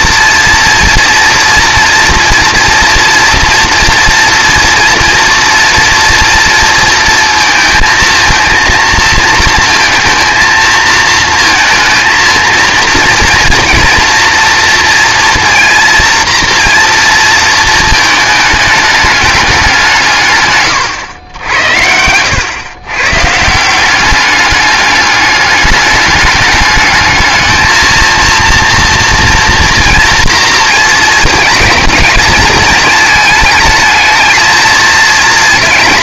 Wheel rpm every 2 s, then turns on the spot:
230, 230, 230, 230, 230, 230, 230, 230, 230, 220, 140, 120, 200, 210, 230, 230, 220, 230.
none